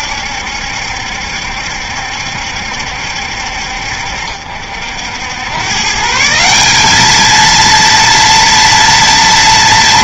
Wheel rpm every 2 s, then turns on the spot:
70, 70, 70, 210, 230.
none